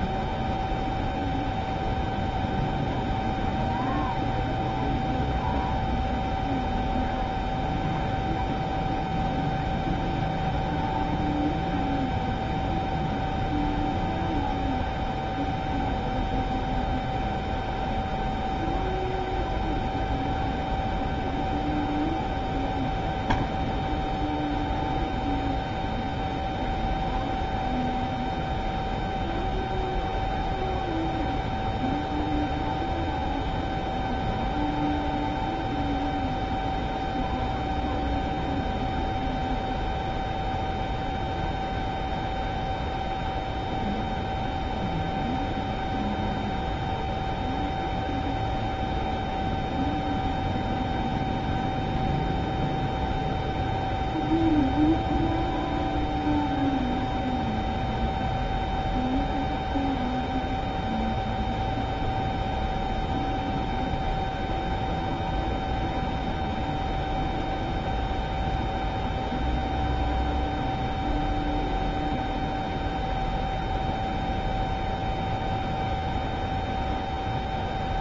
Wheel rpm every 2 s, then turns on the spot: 0, 0, 0, 0, 0, 0, 0, 0, 0, 0, 0, 0, 0, 0, 0, 0, 0, 0, 0, 0, 0, 0, 0, 0, 0, 0, 0, 0, 0, 0, 0, 0, 0, 0, 0, 0, 0, 0, 0.
none